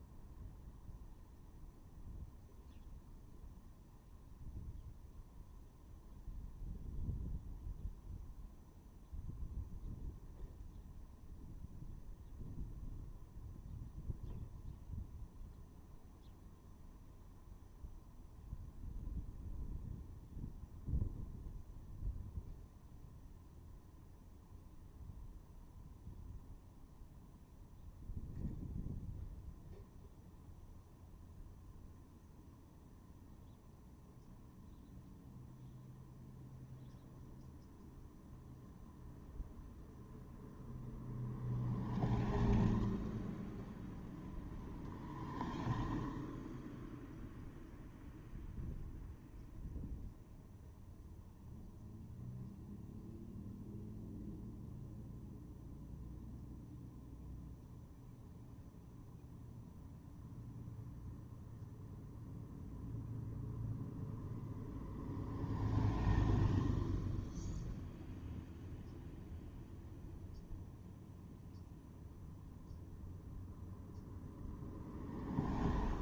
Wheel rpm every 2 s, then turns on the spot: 0, 0, 0, 0, 0, 0, 0, 0, 0, 0, 0, 0, 0, 0, 0, 0, 0, 0, 0, 0, 0, 0, 0, 0, 0, 0, 0, 0, 0, 0, 0, 0, 0, 0, 0, 0, 0, 0.
none